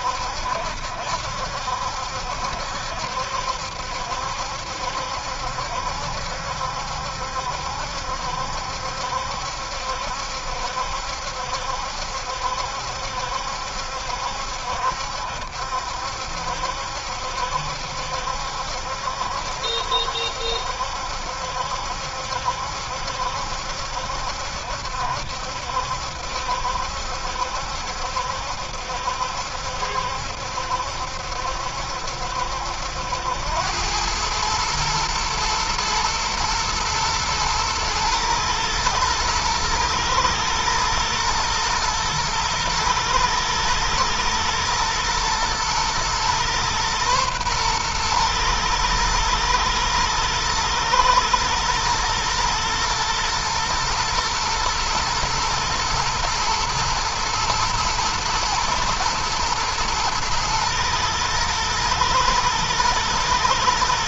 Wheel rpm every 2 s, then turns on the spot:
70, 70, 70, 70, 70, 70, 70, 70, 70, 70, 70, 70, 70, 70, 70, 70, 80, 110, 120, 110, 120, 110, 120, 120, 110, 120, 120, 110, 120, 110, 110, 110.
none